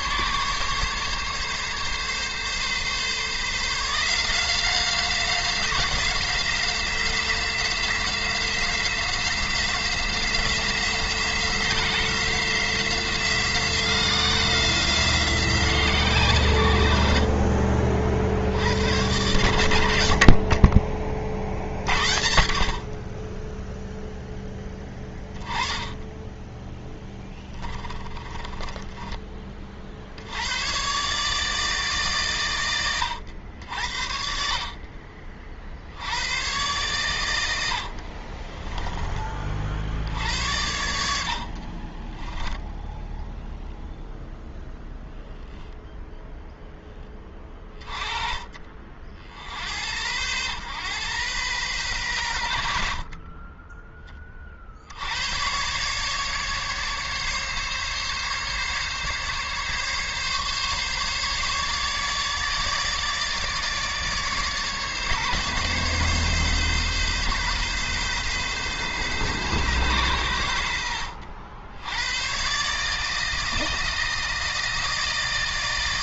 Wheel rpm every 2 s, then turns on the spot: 140, 140, 180, 180, 180, 180, 180, 170, 80, 110, 50, 40, 10, 10, 20, 130, 100, 40, 110, 20, 80, 0, 0, 10, 40, 110, 50, 70, 140, 140, 140, 150, 140, 140, 130, 80, 150, 160.
26-30 32-34